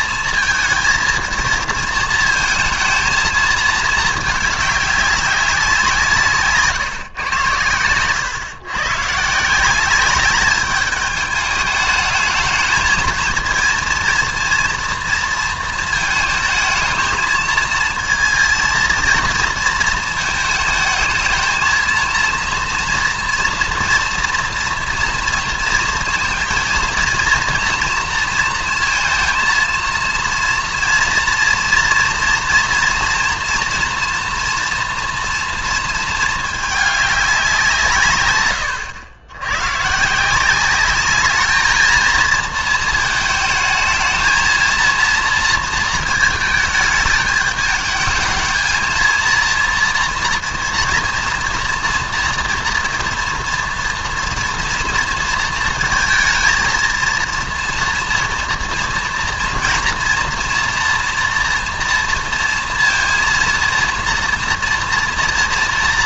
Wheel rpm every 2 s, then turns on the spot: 230, 220, 210, 160, 120, 200, 220, 230, 220, 230, 220, 230, 230, 230, 230, 230, 240, 230, 210, 100, 190, 220, 220, 220, 220, 230, 230, 230, 230, 230, 230, 230, 230.
none